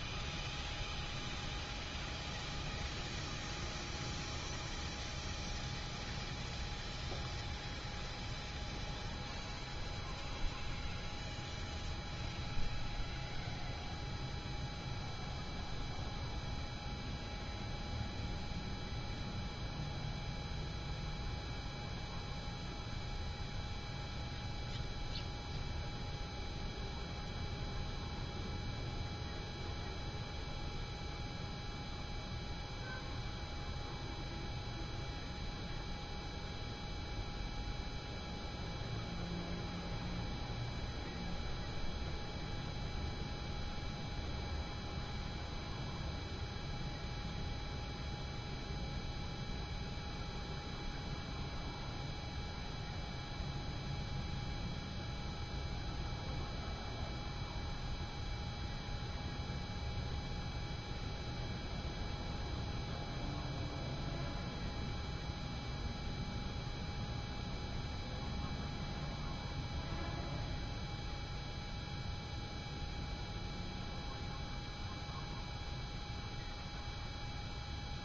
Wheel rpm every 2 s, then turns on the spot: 0, 0, 0, 0, 0, 0, 0, 0, 0, 0, 0, 0, 0, 0, 0, 0, 0, 0, 0, 0, 0, 0, 0, 0, 0, 0, 0, 0, 0, 0, 0, 0, 0, 0, 0, 0, 0, 0, 0.
none